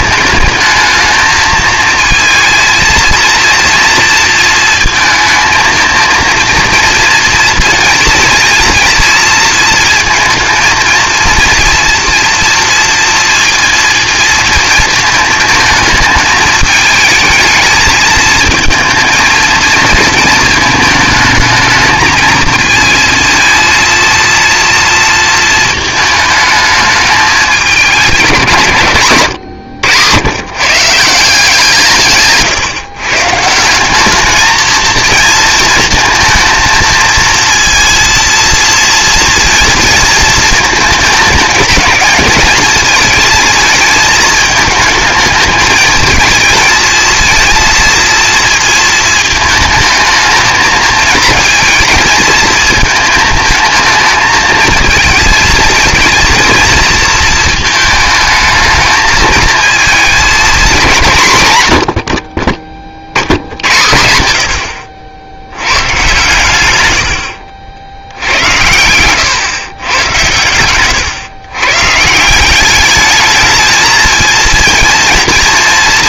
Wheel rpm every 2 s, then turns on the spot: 220, 230, 230, 240, 230, 220, 230, 230, 220, 230, 220, 220, 230, 220, 160, 110, 150, 220, 220, 240, 220, 220, 220, 230, 230, 220, 220, 220, 230, 220, 210, 50, 80, 120, 100, 110, 200, 230.
none